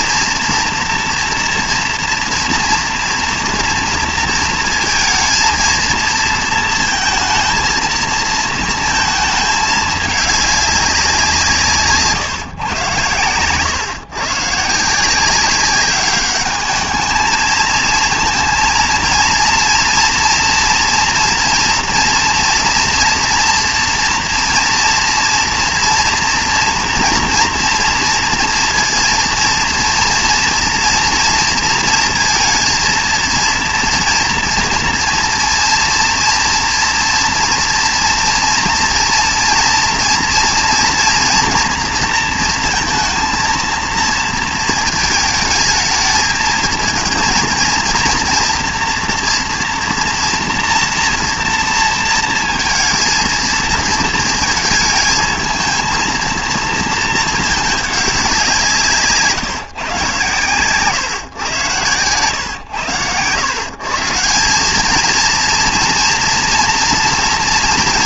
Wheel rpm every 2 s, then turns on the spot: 240, 230, 230, 230, 230, 210, 130, 140, 210, 230, 230, 230, 230, 230, 240, 230, 230, 230, 230, 230, 230, 230, 230, 220, 230, 230, 230, 220, 220, 180, 130, 110, 190, 240.
none